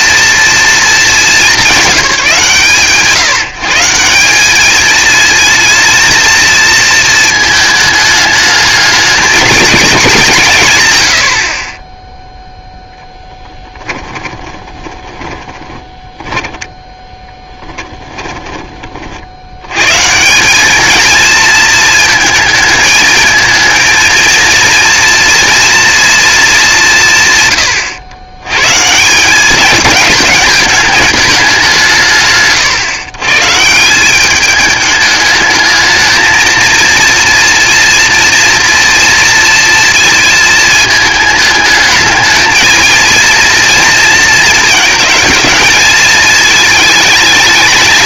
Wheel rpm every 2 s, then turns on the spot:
220, 130, 220, 230, 210, 140, 0, 20, 10, 40, 210, 220, 230, 200, 140, 210, 120, 210, 230, 230, 220, 230, 220, 220.
14-18